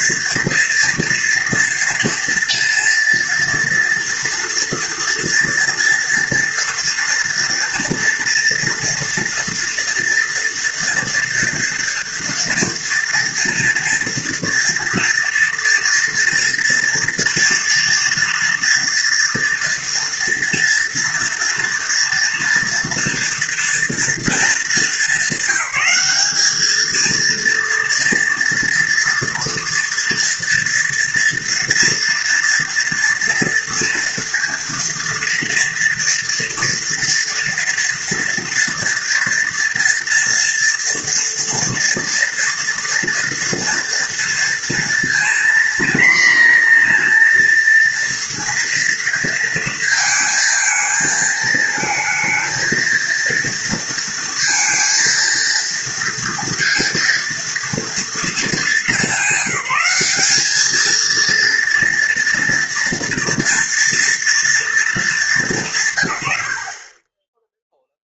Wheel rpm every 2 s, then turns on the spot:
230, 230, 230, 230, 240, 240, 230, 230, 230, 230, 230, 240, 210, 220, 230, 230, 240, 230, 230, 230, 230, 230, 230, 240, 230, 220, 230, 230, 230, 200, 220, 230, 220, 40.
none